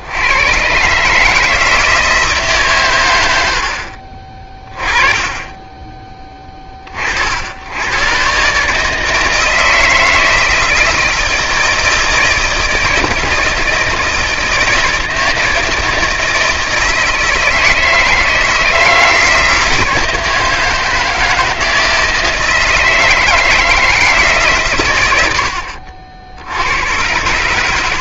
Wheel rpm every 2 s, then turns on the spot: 90, 160, 30, 30, 130, 160, 160, 160, 160, 160, 160, 160, 150, 80.
none